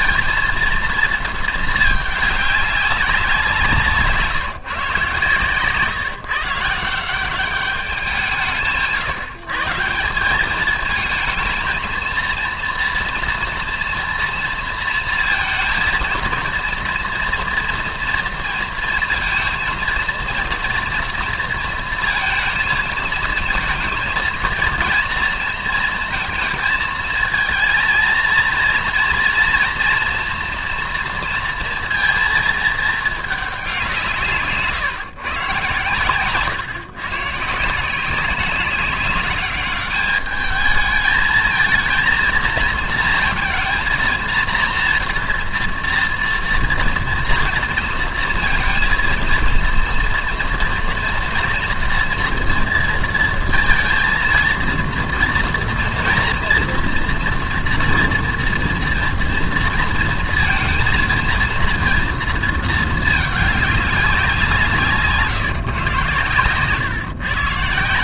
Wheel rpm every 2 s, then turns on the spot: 230, 200, 160, 160, 160, 210, 230, 230, 230, 230, 230, 220, 230, 230, 230, 240, 220, 150, 130, 190, 210, 230, 230, 230, 230, 240, 230, 230, 230, 240, 230, 230, 160, 120.
none